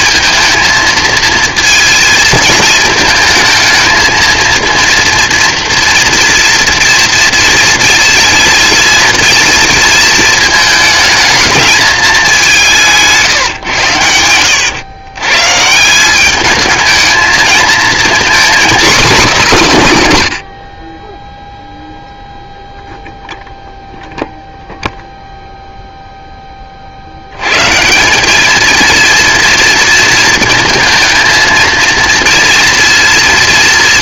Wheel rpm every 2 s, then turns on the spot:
220, 220, 230, 230, 230, 220, 180, 100, 210, 250, 90, 0, 0, 20, 210, 230, 230.
none